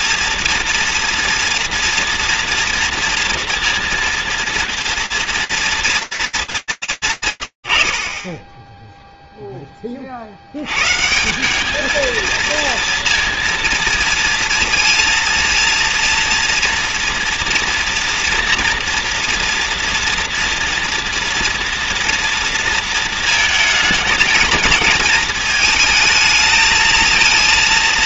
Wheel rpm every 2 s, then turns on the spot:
230, 240, 230, 210, 10, 70, 230, 230, 230, 230, 230, 230, 220, 220.
none